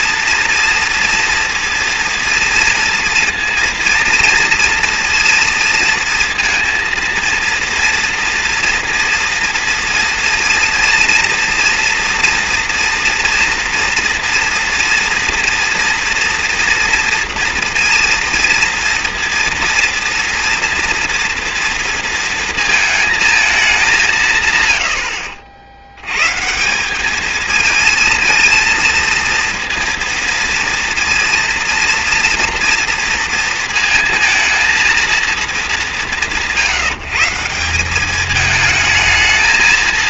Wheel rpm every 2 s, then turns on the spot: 230, 230, 230, 230, 230, 230, 230, 230, 230, 230, 230, 220, 110, 170, 230, 230, 230, 230, 170, 210.
none